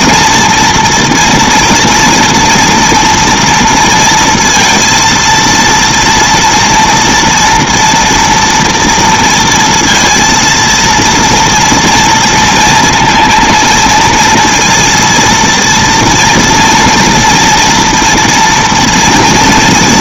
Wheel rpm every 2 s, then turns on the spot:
230, 230, 230, 230, 230, 230, 230, 230, 230, 240.
none